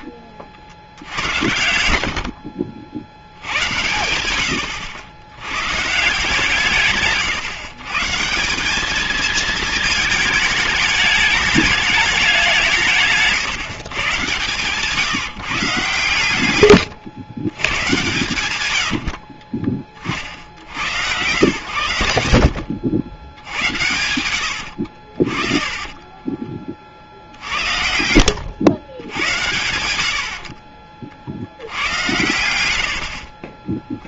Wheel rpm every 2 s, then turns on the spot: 50, 50, 90, 160, 190, 210, 180, 140, 100, 150, 50, 70, 90, 30, 100, 50, 90.
2-4 16-18 22-26